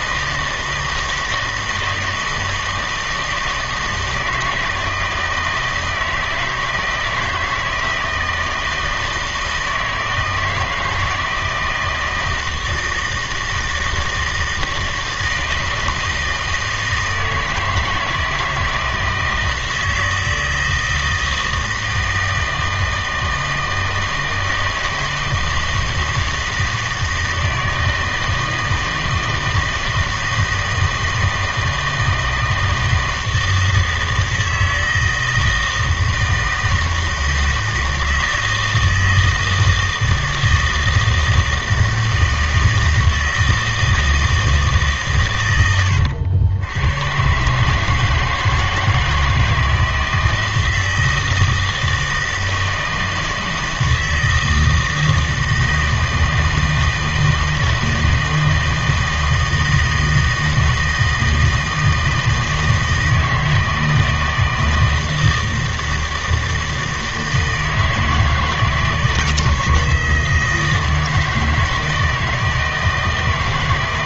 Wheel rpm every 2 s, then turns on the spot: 160, 160, 160, 160, 160, 160, 160, 160, 160, 170, 160, 160, 160, 160, 160, 160, 160, 160, 160, 160, 160, 160, 150, 90, 160, 160, 160, 160, 160, 160, 160, 160, 160, 160, 160, 160, 160.
none